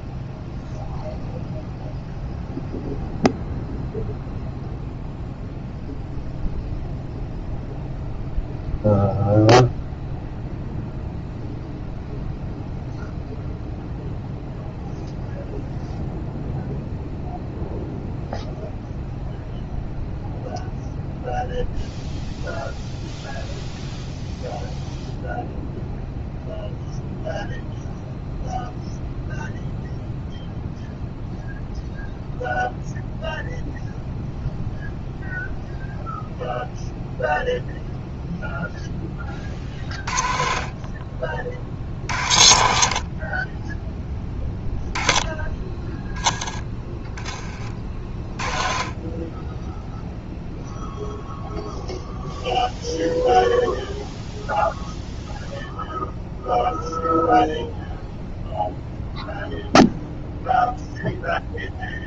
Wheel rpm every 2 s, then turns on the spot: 0, 0, 0, 0, 0, 0, 0, 0, 0, 0, 0, 0, 0, 0, 0, 0, 0, 0, 0, 10, 40, 60, 10, 10, 30, 0, 0, 0, 0, 0, 0.
none